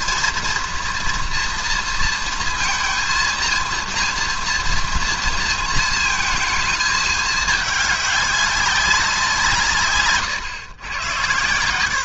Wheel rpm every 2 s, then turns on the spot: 230, 230, 230, 220, 200, 120.
none